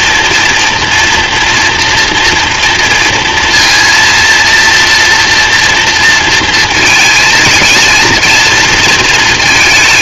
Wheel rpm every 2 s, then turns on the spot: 240, 230, 230, 220, 220.
none